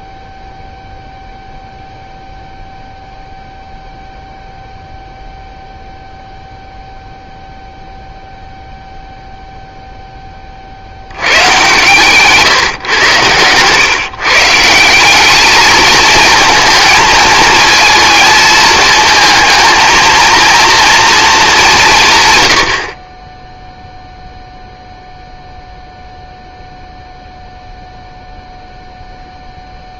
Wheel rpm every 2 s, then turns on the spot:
0, 0, 0, 0, 0, 40, 140, 160, 220, 220, 230, 90, 0, 0, 0.
none